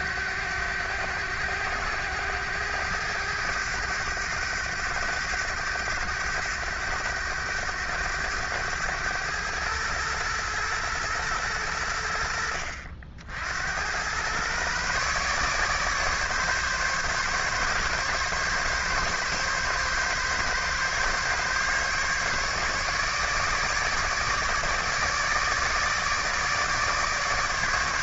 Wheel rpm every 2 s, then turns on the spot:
100, 100, 100, 100, 100, 120, 70, 130, 140, 140, 140, 150, 150, 150.
none